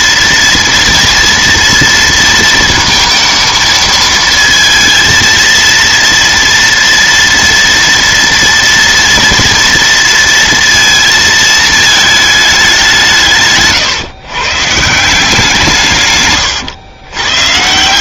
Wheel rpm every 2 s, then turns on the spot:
230, 230, 230, 230, 230, 230, 200, 150, 120.
none